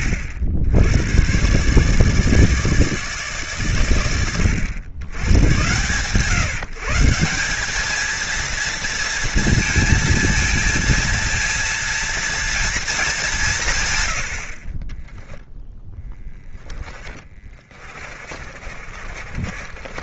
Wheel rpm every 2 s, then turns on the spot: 90, 160, 100, 160, 230, 230, 220, 20, 20, 40.
16-20